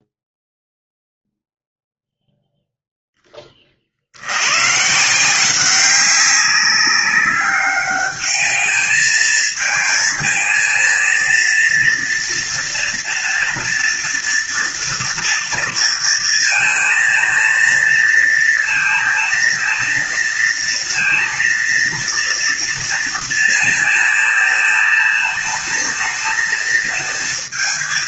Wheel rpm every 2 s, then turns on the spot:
0, 0, 130, 200, 220, 220, 230, 230, 220, 230, 230, 230, 220, 220.
none